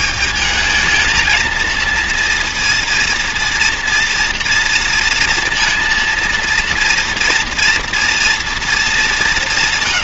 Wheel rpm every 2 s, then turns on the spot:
220, 230, 230, 230, 220.
none